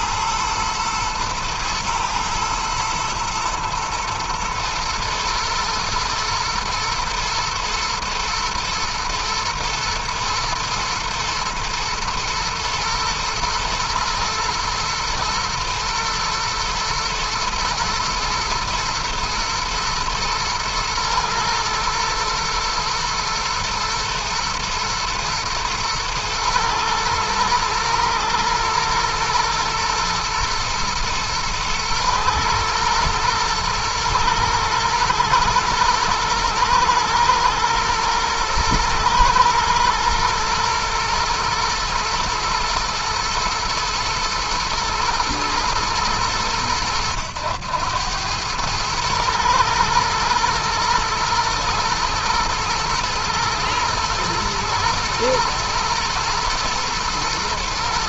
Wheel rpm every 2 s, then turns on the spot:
110, 120, 120, 110, 110, 120, 110, 110, 110, 120, 110, 120, 110, 110, 110, 110, 110, 110, 110, 120, 120, 120, 110, 100, 110, 110, 110, 110, 120.
none